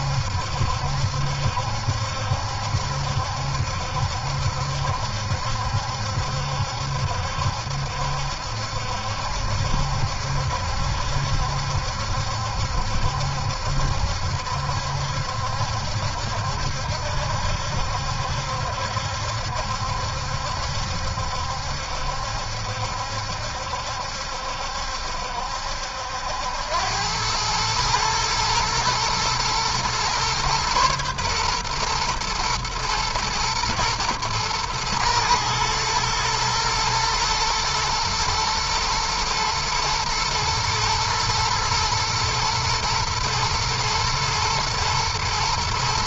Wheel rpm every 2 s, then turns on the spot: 70, 70, 70, 70, 70, 70, 70, 70, 70, 70, 70, 70, 70, 90, 110, 120, 120, 110, 120, 110, 120, 110, 110.
none